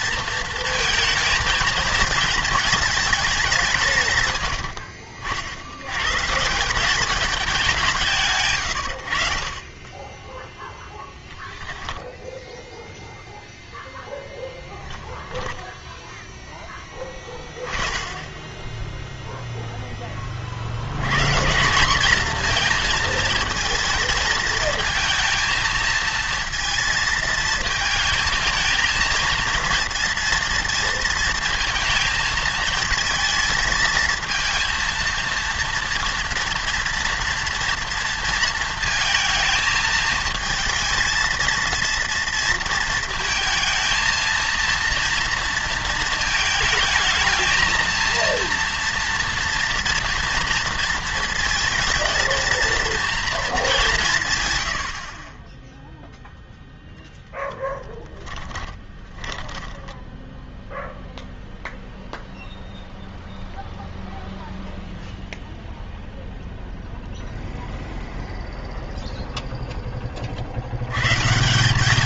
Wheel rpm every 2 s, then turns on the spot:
230, 220, 80, 170, 120, 10, 0, 10, 10, 10, 80, 230, 220, 220, 220, 230, 220, 230, 230, 230, 220, 230, 230, 220, 230, 230, 230, 100, 0, 20, 0, 0, 0, 0, 0, 80.
4-6 10-12 14-16 58-60